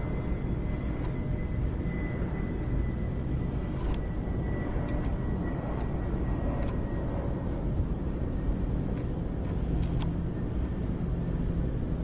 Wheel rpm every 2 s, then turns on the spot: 0, 0, 0, 0, 0, 0.
none